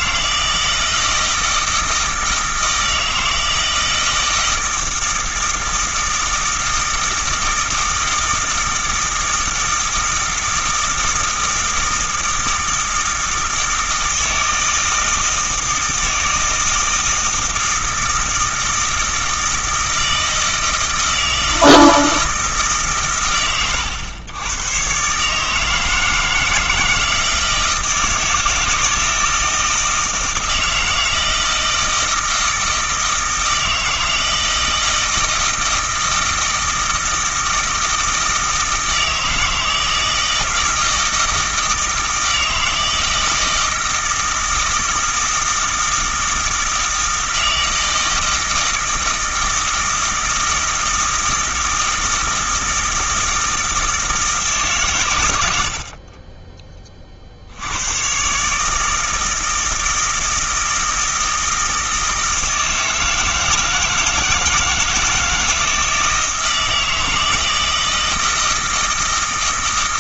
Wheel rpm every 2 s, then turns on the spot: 160, 160, 160, 160, 160, 160, 160, 160, 160, 160, 160, 150, 110, 160, 160, 160, 160, 160, 160, 160, 160, 160, 160, 160, 160, 160, 160, 150, 20, 150, 160, 160, 160, 160, 160.
none